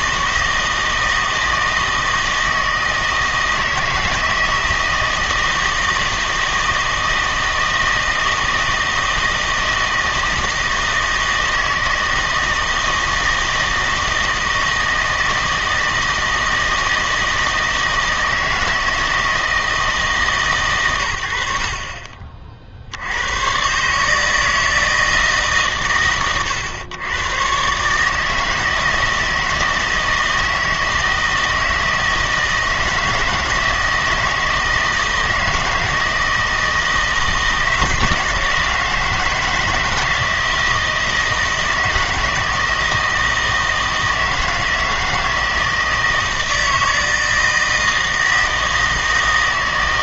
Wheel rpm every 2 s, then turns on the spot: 160, 160, 160, 160, 160, 160, 160, 160, 160, 160, 130, 60, 160, 120, 160, 160, 160, 160, 160, 160, 160, 160, 160, 160, 160.
none